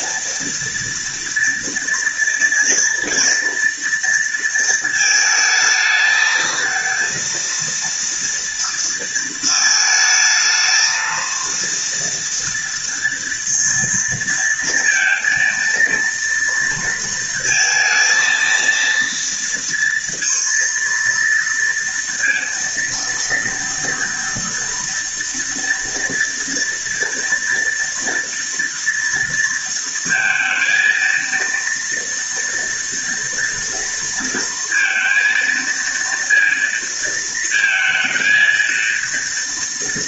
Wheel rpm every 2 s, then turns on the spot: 230, 230, 230, 220, 230, 220, 230, 230, 230, 230, 230, 230, 230, 230, 230, 230, 240, 230, 230, 230.
none